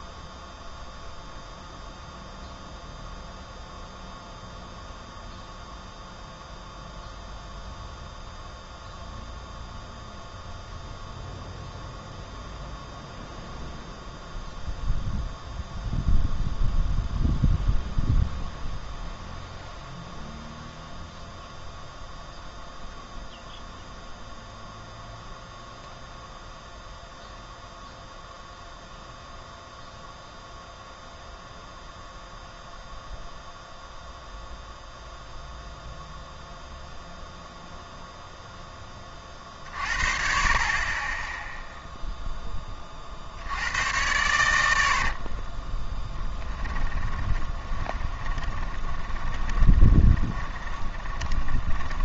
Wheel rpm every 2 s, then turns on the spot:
0, 0, 0, 0, 0, 0, 0, 0, 0, 0, 0, 0, 0, 0, 0, 0, 0, 0, 0, 10, 30, 20, 90, 20, 10, 20.
46-52